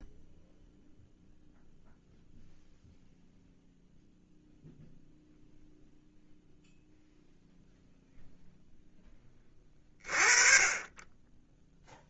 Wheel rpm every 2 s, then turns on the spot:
0, 0, 0, 0, 10, 20.
none